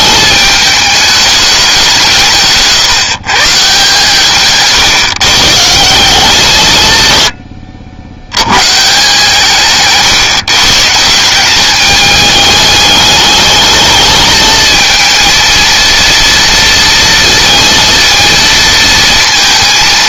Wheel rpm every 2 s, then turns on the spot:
210, 150, 140, 140, 130, 150, 210, 220, 230, 230.
none